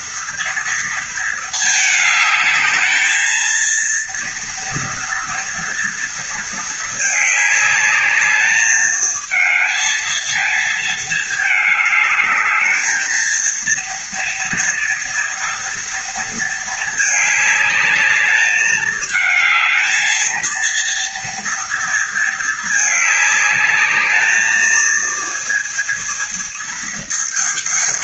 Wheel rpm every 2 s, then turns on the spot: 230, 220, 230, 220, 220, 220, 220, 230, 220, 210, 230, 210, 230, 220.
none